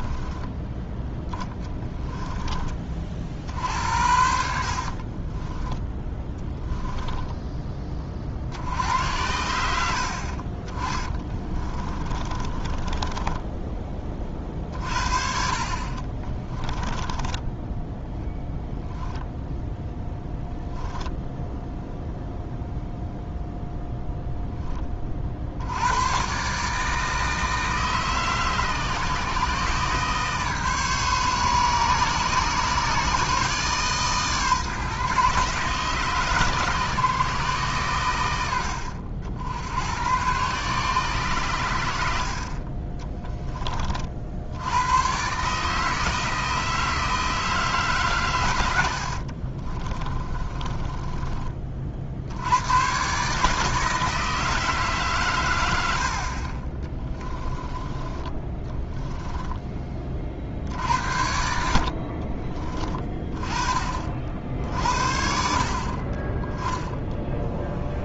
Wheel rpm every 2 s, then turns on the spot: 10, 50, 30, 10, 80, 30, 20, 40, 20, 0, 0, 0, 20, 150, 150, 150, 140, 140, 140, 70, 130, 20, 110, 160, 80, 20, 110, 150, 20, 10, 70, 30, 50, 10.
4-8 10-18 48-52 56-60